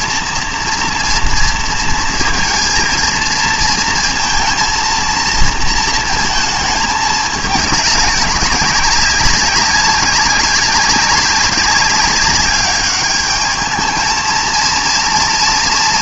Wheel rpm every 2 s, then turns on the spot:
230, 230, 230, 220, 190, 200, 200, 230.
none